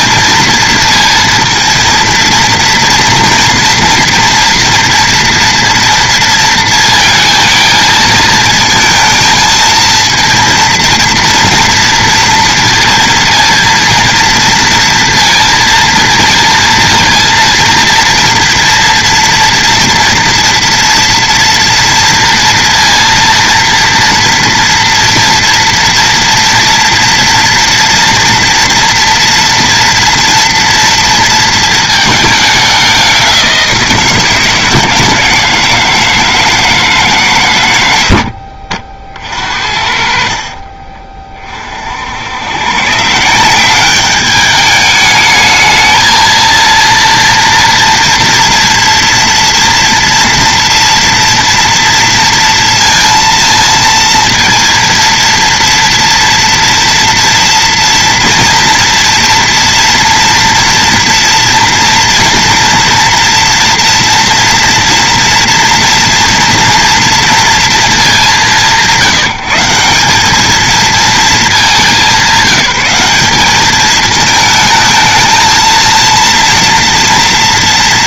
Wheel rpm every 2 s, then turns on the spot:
230, 230, 230, 230, 220, 230, 230, 230, 230, 230, 230, 230, 230, 230, 230, 240, 200, 160, 160, 80, 40, 100, 210, 230, 240, 230, 230, 230, 230, 230, 240, 230, 230, 230, 190, 200, 190, 220, 230.
40-42